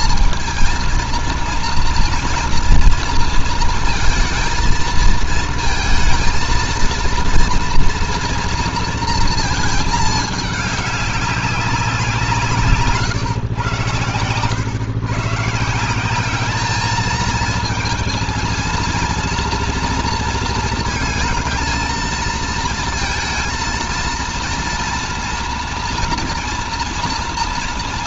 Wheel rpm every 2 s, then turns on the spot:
230, 230, 230, 230, 230, 200, 140, 100, 210, 230, 230, 230, 230, 240.
none